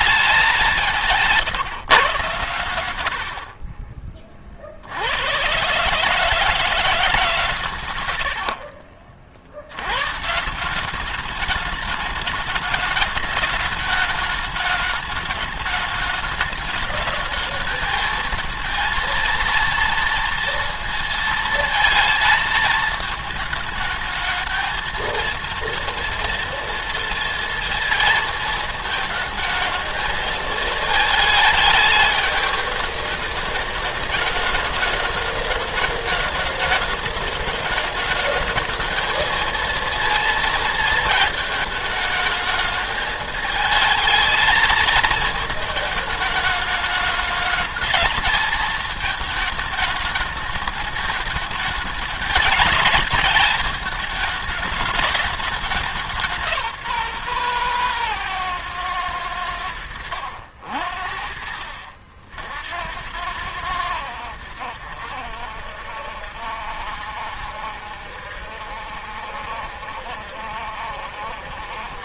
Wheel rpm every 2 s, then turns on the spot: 200, 100, 40, 160, 80, 150, 210, 210, 220, 230, 230, 220, 220, 230, 220, 220, 210, 210, 210, 210, 230, 220, 220, 210, 220, 210, 210, 210, 170, 130, 70, 70, 80, 70, 70, 70.
none